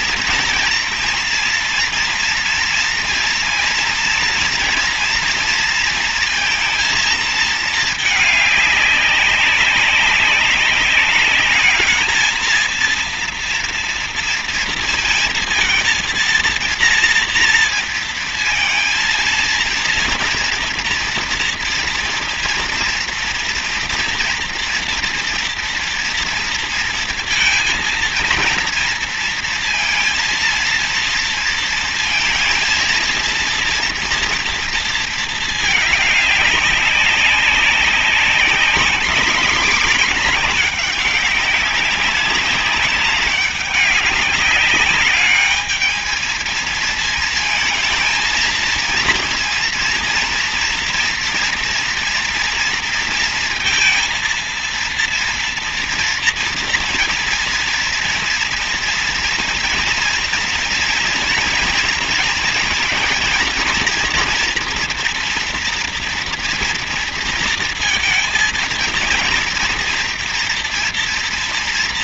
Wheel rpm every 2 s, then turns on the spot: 230, 230, 230, 230, 210, 200, 220, 230, 230, 230, 230, 230, 230, 230, 230, 230, 230, 230, 200, 210, 210, 200, 200, 220, 230, 230, 230, 230, 230, 230, 230, 230, 230, 230, 220, 230.
none